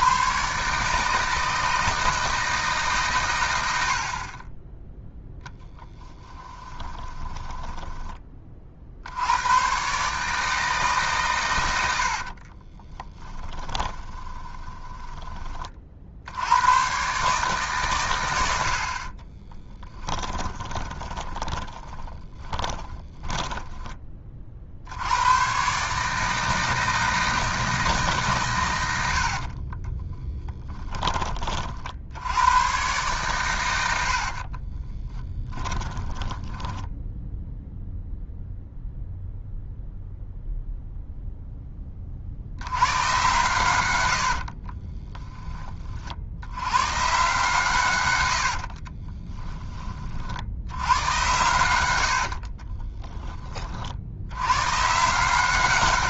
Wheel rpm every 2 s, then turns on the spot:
150, 140, 10, 10, 50, 150, 30, 20, 110, 60, 20, 20, 70, 160, 100, 10, 120, 30, 10, 0, 0, 90, 20, 120, 40, 90, 20, 140.
6-8 12-16 20-24 28-30 34-38 44-46 48-50 52-54